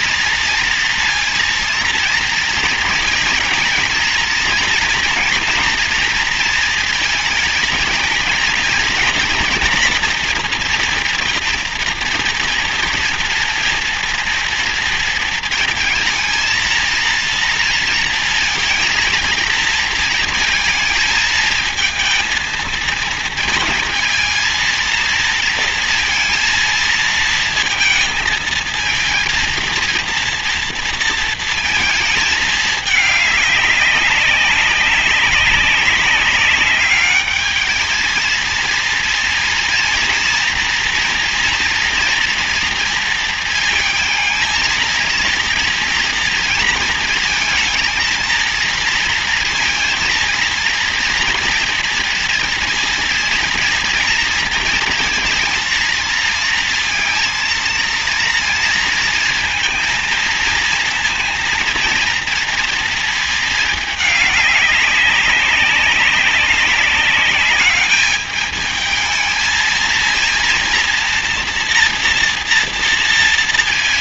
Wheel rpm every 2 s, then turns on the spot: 230, 230, 230, 220, 230, 230, 230, 230, 230, 220, 220, 220, 230, 230, 230, 230, 210, 190, 210, 230, 230, 230, 230, 220, 230, 230, 230, 230, 230, 230, 230, 220, 190, 200, 220, 230, 230.
none